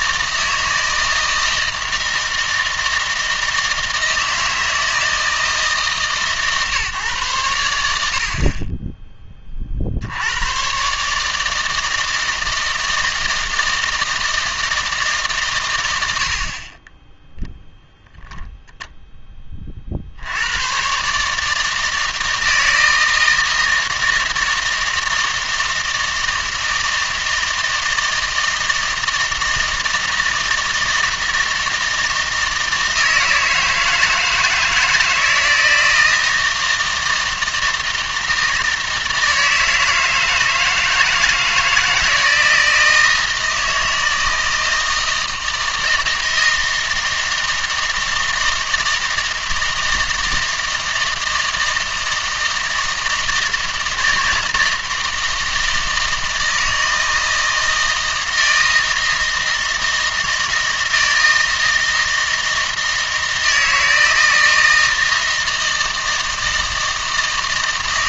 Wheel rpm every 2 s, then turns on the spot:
160, 160, 160, 140, 20, 130, 160, 160, 30, 0, 110, 160, 160, 160, 160, 160, 160, 160, 160, 160, 160, 160, 160, 160, 160, 160, 160, 160, 160, 160, 160, 160, 160, 160.
none